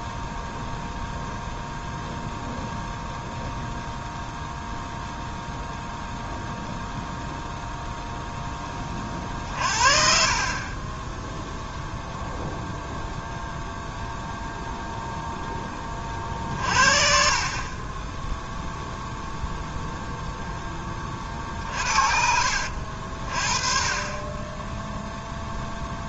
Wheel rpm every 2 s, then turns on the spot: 0, 0, 0, 0, 30, 20, 0, 0, 40, 0, 20, 50, 0.
none